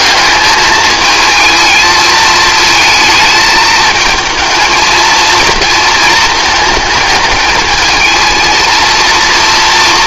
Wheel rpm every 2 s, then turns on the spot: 210, 220, 220, 220, 230.
none